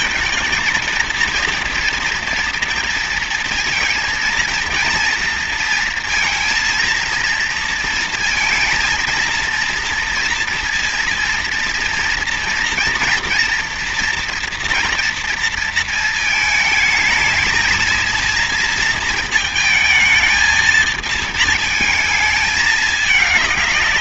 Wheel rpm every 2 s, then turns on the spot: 230, 230, 230, 230, 230, 230, 230, 240, 220, 230, 220, 210.
none